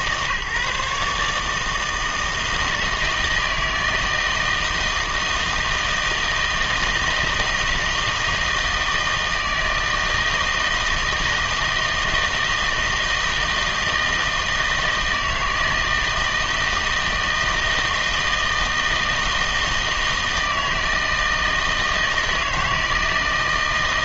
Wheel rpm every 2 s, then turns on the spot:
150, 160, 160, 160, 160, 160, 160, 160, 160, 160, 160, 160.
none